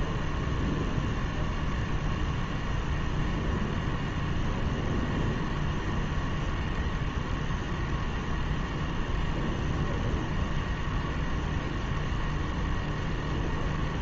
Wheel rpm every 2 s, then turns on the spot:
0, 0, 0, 0, 0, 0, 0.
none